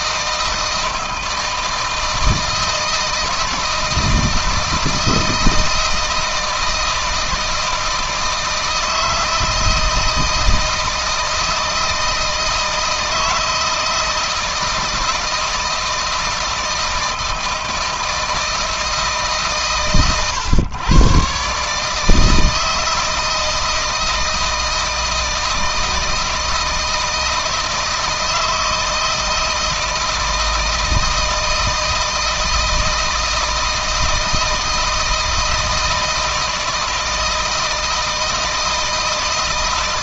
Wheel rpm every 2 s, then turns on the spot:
160, 160, 160, 160, 160, 160, 160, 160, 160, 160, 120, 160, 160, 160, 160, 160, 160, 160, 160, 160.
none